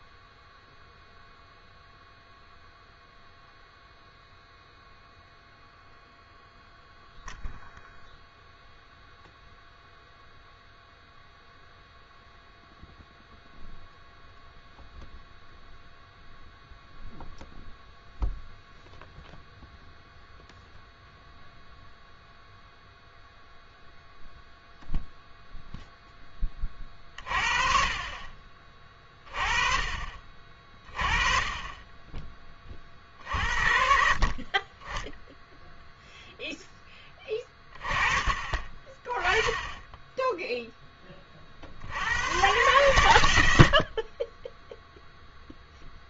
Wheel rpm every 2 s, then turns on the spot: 0, 0, 0, 0, 0, 0, 0, 0, 0, 0, 0, 0, 0, 20, 30, 40, 30, 30, 10, 30, 0, 110, 10.
none